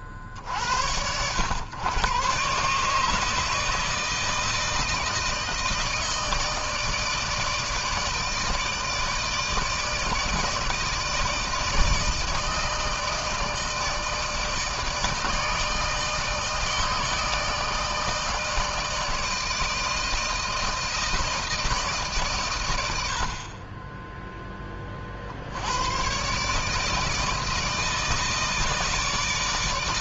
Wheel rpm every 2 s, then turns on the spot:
50, 130, 160, 160, 160, 160, 160, 160, 160, 160, 160, 120, 20, 140, 160.
none